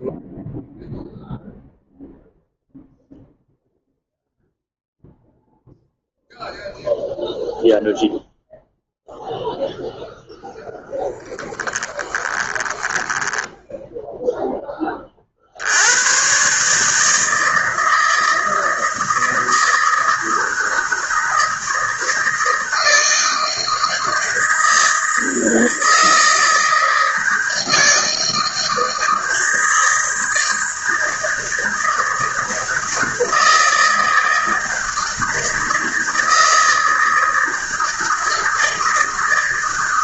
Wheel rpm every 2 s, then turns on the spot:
0, 0, 0, 0, 0, 0, 10, 10, 130, 160, 160, 160, 160, 160, 160, 160, 160, 160, 160, 160.
12-14